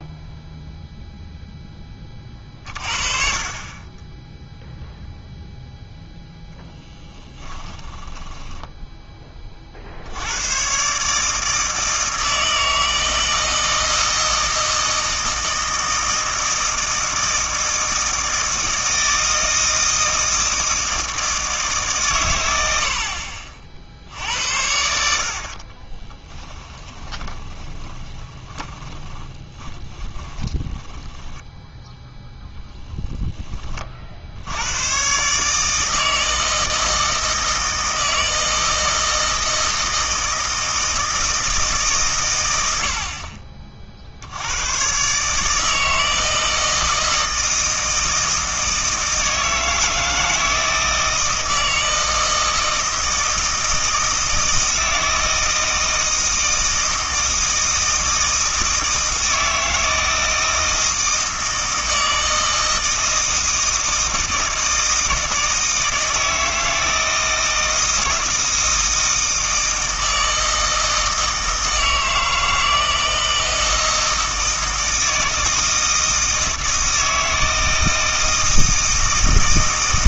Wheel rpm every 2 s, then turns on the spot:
0, 40, 0, 10, 10, 120, 160, 160, 160, 160, 160, 100, 70, 10, 10, 10, 0, 100, 160, 160, 160, 90, 110, 160, 160, 160, 160, 160, 160, 160, 160, 160, 160, 160, 160, 160, 160, 160, 160, 160.
6-10 26-32